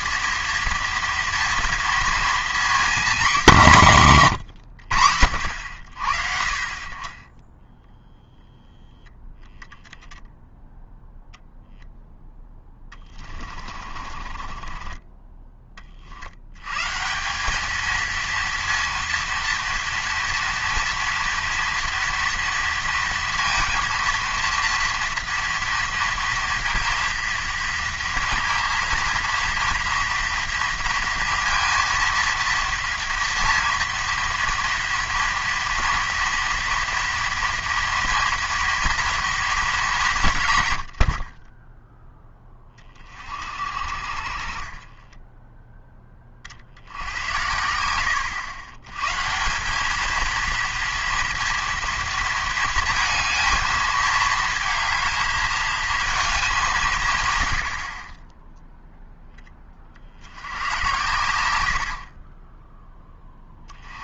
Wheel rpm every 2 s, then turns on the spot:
230, 240, 130, 40, 0, 0, 10, 30, 110, 230, 230, 230, 230, 230, 230, 230, 230, 230, 230, 230, 120, 20, 40, 60, 100, 230, 230, 220, 200, 10, 90, 20.
12-16